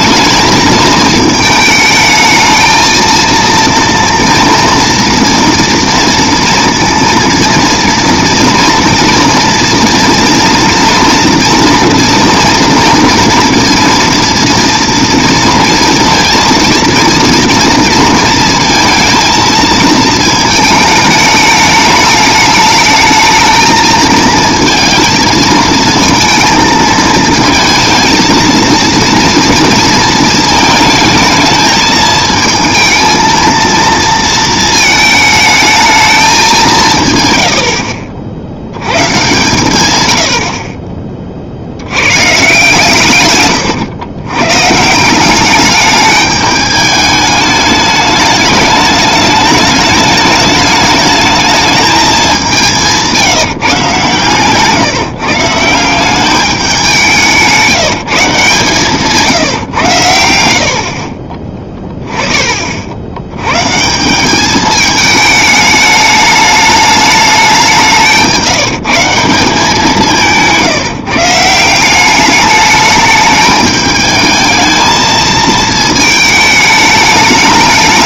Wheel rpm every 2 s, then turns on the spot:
220, 220, 230, 230, 230, 240, 230, 230, 230, 230, 220, 210, 230, 230, 230, 220, 220, 220, 180, 100, 50, 140, 140, 210, 210, 210, 180, 140, 200, 150, 70, 50, 210, 210, 170, 150, 210, 220, 210.
40-42